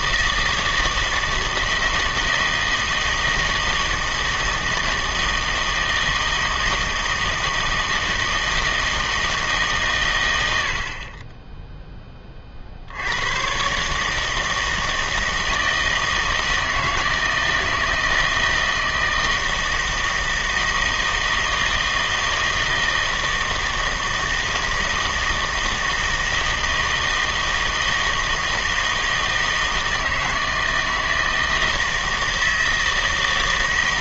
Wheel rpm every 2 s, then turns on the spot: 160, 160, 160, 160, 160, 60, 60, 160, 160, 160, 160, 160, 160, 160, 160, 160, 160.
none